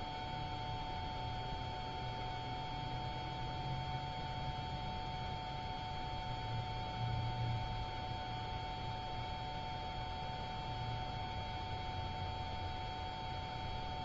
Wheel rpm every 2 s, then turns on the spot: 0, 0, 0, 0, 0, 0, 0.
none